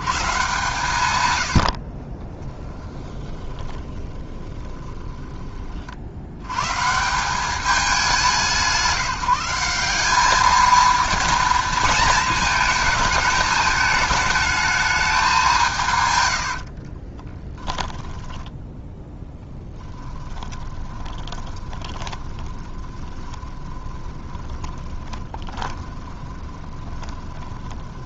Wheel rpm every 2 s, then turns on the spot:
150, 10, 20, 140, 170, 220, 220, 210, 50, 10, 20, 20, 20, 20.
2-6 16-18 20-28